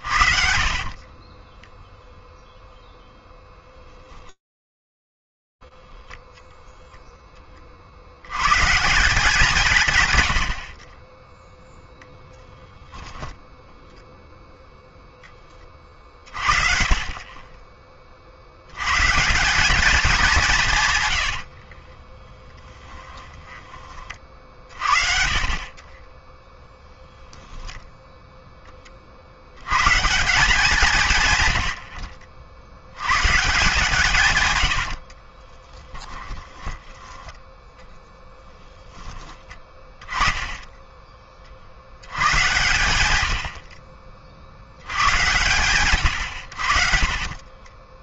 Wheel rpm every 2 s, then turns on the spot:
50, 0, 10, 0, 160, 50, 10, 20, 30, 190, 60, 20, 40, 0, 120, 90, 160, 20, 20, 20, 70, 50, 140, 20.
12-14 20-22 34-36 46-48